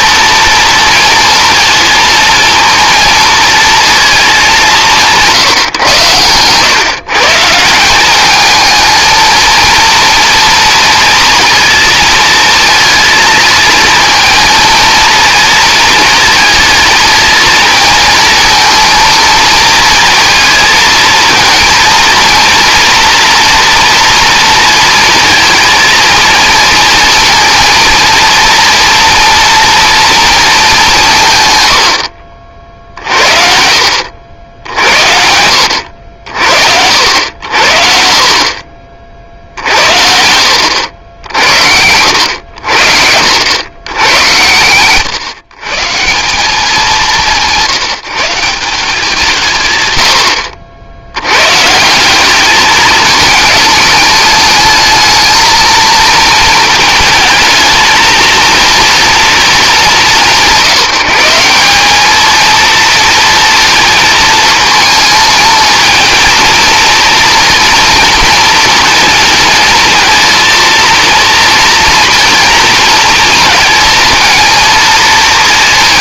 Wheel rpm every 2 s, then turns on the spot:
230, 230, 200, 130, 220, 230, 230, 220, 230, 230, 220, 230, 230, 230, 230, 210, 50, 70, 70, 40, 80, 80, 110, 190, 180, 70, 210, 220, 220, 230, 180, 230, 220, 230, 230, 230, 230, 230.
none